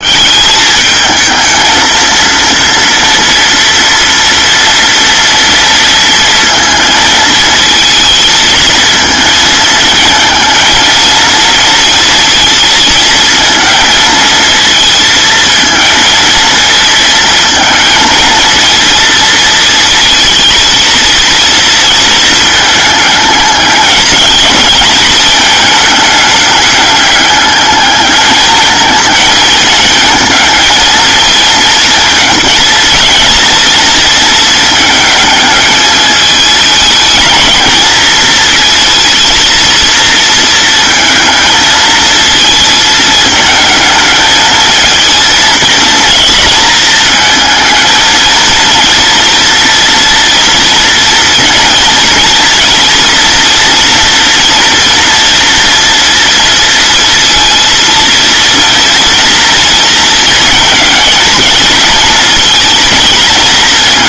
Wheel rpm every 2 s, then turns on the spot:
200, 230, 240, 230, 220, 220, 220, 220, 230, 220, 220, 220, 220, 210, 210, 220, 230, 220, 210, 230, 230, 220, 220, 230, 230, 230, 230, 240, 230, 230, 230, 230.
none